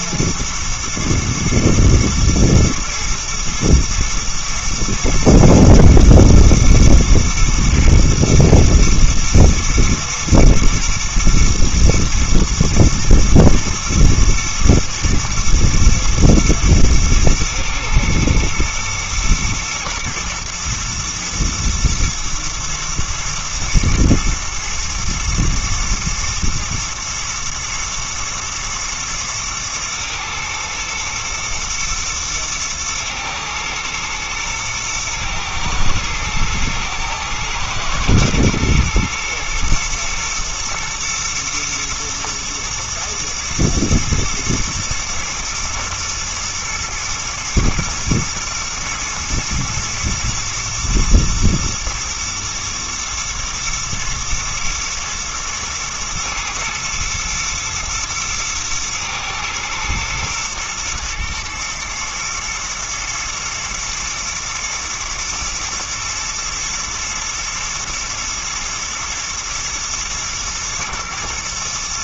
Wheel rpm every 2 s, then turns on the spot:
120, 120, 110, 120, 120, 110, 110, 110, 110, 110, 110, 120, 110, 120, 110, 120, 110, 120, 110, 120, 120, 110, 120, 120, 120, 110, 120, 110, 110, 110, 110, 110, 120, 110, 120, 110.
none